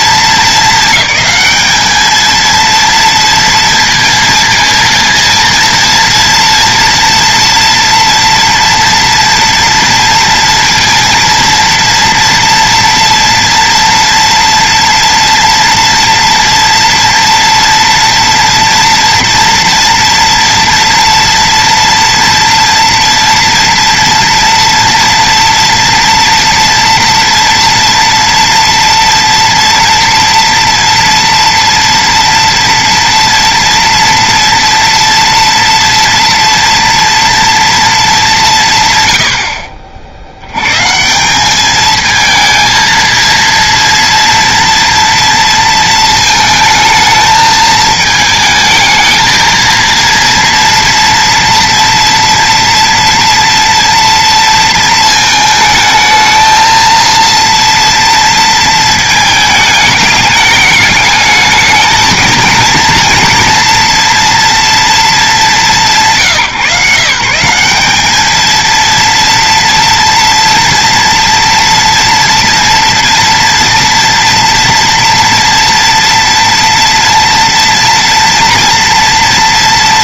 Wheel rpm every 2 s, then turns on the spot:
220, 230, 230, 230, 230, 230, 230, 230, 230, 230, 230, 230, 230, 230, 230, 230, 230, 230, 230, 150, 120, 230, 230, 220, 220, 230, 230, 230, 220, 230, 210, 240, 230, 150, 220, 230, 230, 230, 230, 230.
none